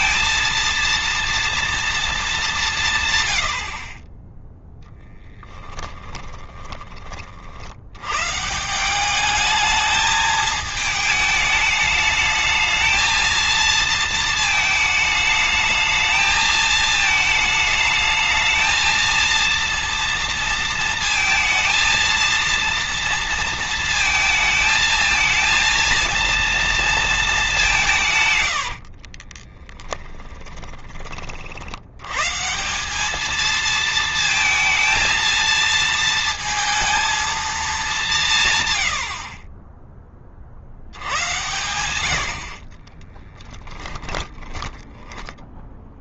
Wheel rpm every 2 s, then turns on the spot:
230, 190, 10, 20, 160, 220, 220, 220, 220, 230, 230, 230, 220, 230, 80, 20, 170, 220, 230, 110, 70, 40, 10.
28-30 42-44